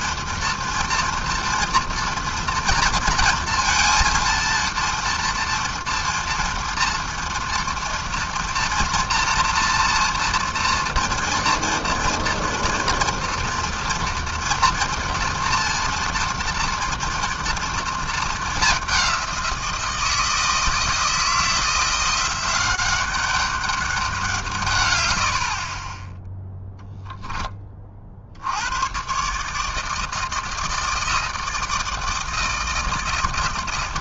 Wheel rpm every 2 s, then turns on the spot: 230, 230, 230, 230, 230, 240, 230, 230, 230, 210, 160, 180, 150, 0, 80, 160, 160.
none